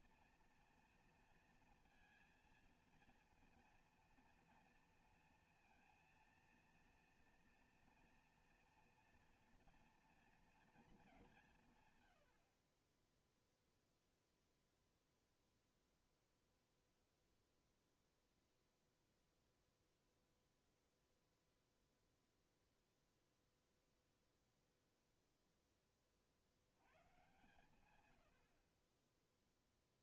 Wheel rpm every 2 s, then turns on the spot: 230, 230, 230, 230, 240, 200, 10, 0, 0, 0, 0, 0, 0, 120, 0.
12-14